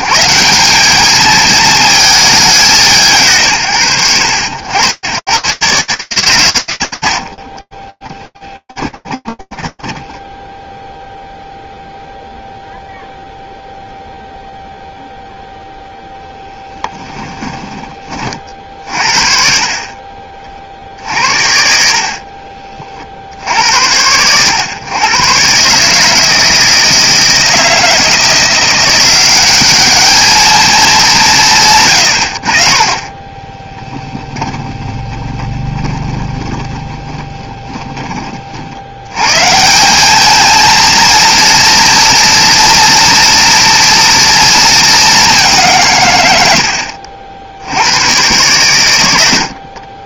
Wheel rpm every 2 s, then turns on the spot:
180, 180, 90, 90, 10, 10, 0, 0, 10, 50, 70, 70, 130, 160, 190, 190, 20, 20, 10, 110, 230, 230, 200, 60, 90.
8-12 16-18 32-38